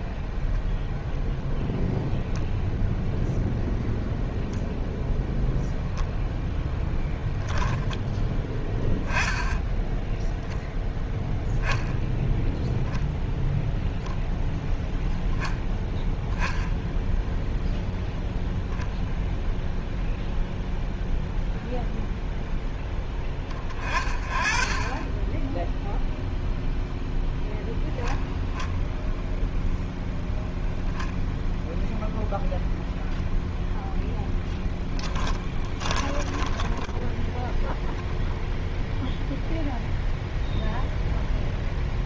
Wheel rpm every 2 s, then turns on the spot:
0, 0, 0, 10, 20, 0, 0, 0, 0, 0, 0, 0, 30, 0, 10, 0, 0, 20, 10, 0, 0.
34-38